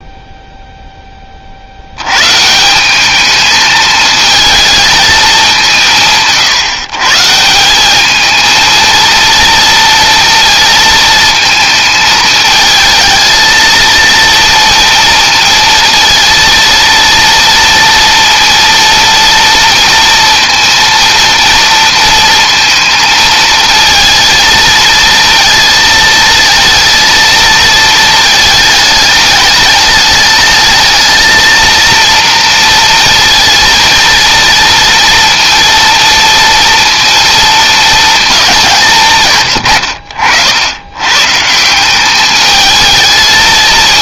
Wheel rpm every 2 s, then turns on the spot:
30, 210, 210, 150, 230, 220, 220, 230, 230, 230, 230, 220, 230, 230, 210, 220, 230, 230, 230, 140, 120, 220.
none